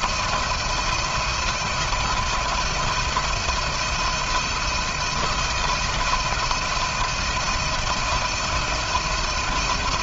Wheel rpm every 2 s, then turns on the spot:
170, 160, 170, 170, 160.
none